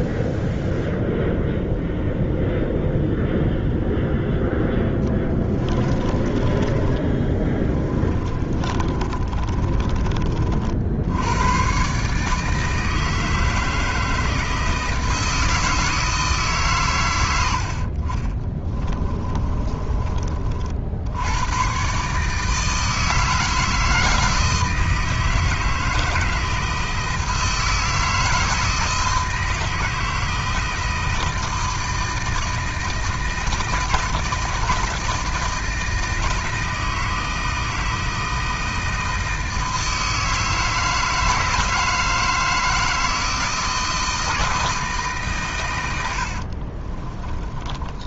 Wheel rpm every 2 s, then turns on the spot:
0, 0, 10, 20, 30, 70, 160, 160, 120, 30, 70, 160, 160, 160, 160, 160, 160, 160, 160, 160, 160, 160, 160, 40.
4-10 18-20 46-48